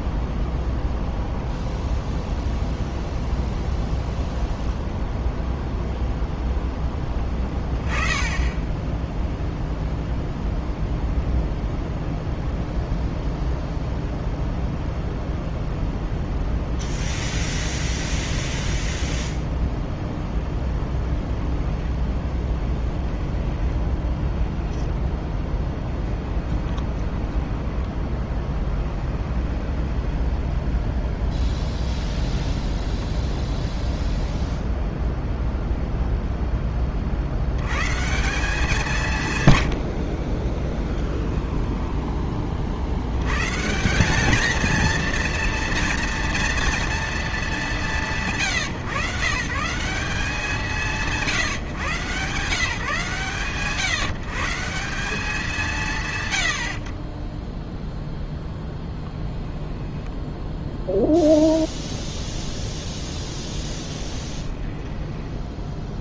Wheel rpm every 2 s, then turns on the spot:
0, 0, 0, 0, 10, 0, 0, 0, 0, 0, 10, 10, 10, 20, 10, 0, 0, 0, 20, 190, 20, 50, 230, 230, 150, 180, 160, 180, 50, 10, 0, 10, 10.
26-30 40-42 64-66